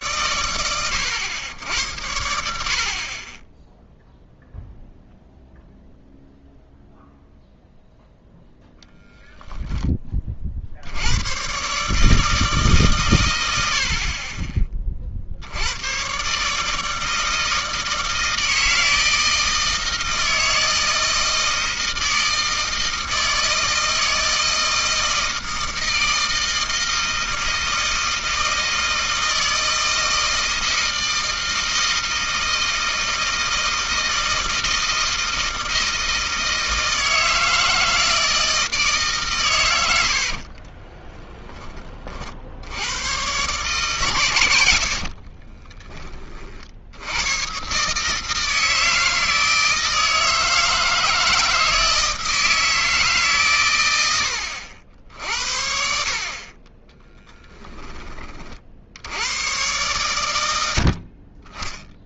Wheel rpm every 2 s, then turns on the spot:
100, 10, 0, 0, 10, 120, 90, 80, 160, 160, 160, 160, 160, 160, 160, 160, 160, 160, 160, 130, 10, 120, 50, 90, 160, 160, 160, 70, 10, 80, 50.
44-46 56-58